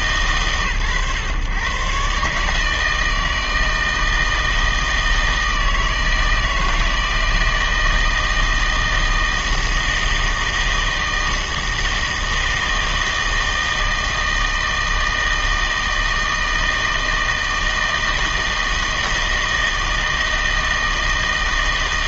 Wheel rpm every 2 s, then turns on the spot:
120, 160, 160, 160, 160, 160, 160, 160, 160, 160, 160.
none